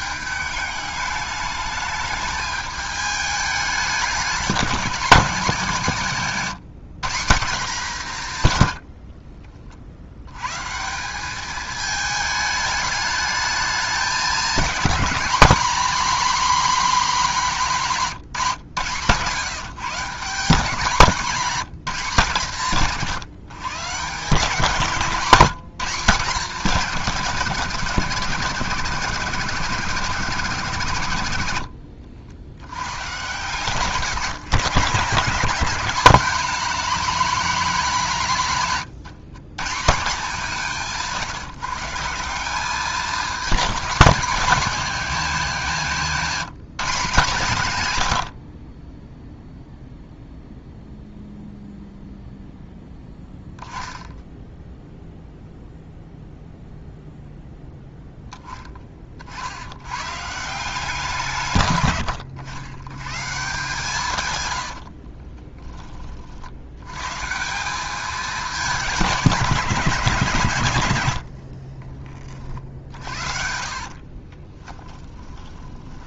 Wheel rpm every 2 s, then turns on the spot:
200, 210, 210, 180, 100, 150, 210, 230, 250, 140, 190, 140, 160, 210, 170, 160, 70, 150, 220, 150, 180, 200, 210, 170, 30, 0, 0, 0, 0, 20, 180, 100, 80, 120, 200, 120, 60, 10.
38-40 64-66 72-76